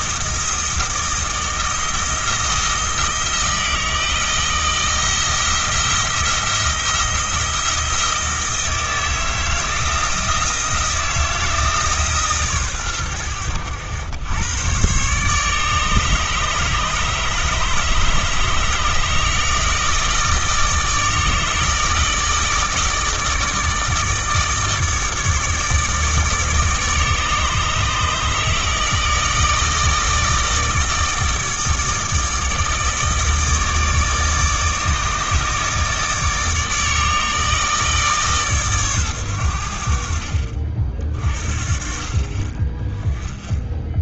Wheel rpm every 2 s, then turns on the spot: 160, 170, 160, 170, 160, 160, 120, 120, 150, 150, 160, 160, 150, 150, 160, 160, 160, 150, 160, 120, 40, 10.
none